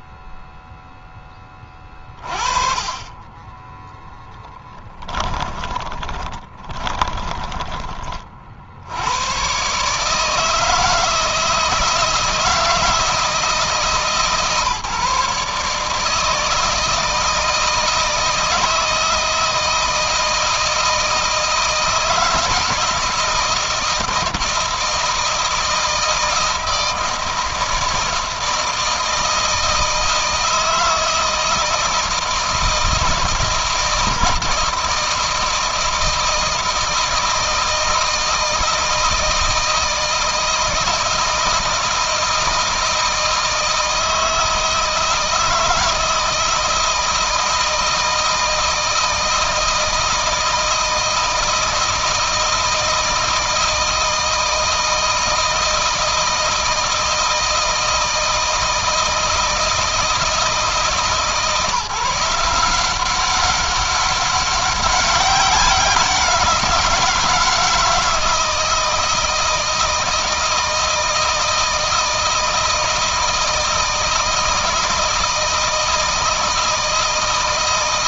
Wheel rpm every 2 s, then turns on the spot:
0, 30, 10, 20, 80, 160, 160, 150, 160, 160, 160, 160, 170, 160, 160, 160, 160, 160, 160, 160, 160, 160, 160, 160, 160, 160, 160, 160, 160, 160, 150, 180, 190, 170, 160, 160, 160, 160, 160.
4-8